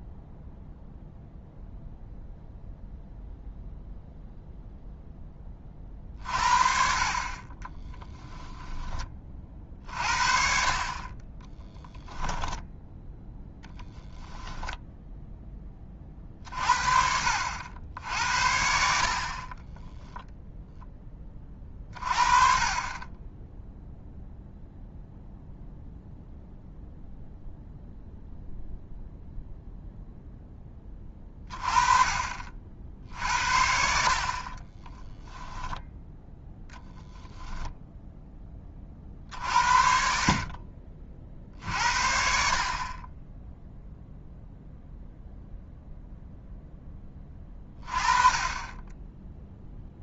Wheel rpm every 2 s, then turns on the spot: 0, 0, 0, 40, 20, 40, 0, 0, 50, 60, 10, 30, 0, 0, 0, 20, 60, 10, 0, 30, 40, 30, 0, 10, 10.
34-36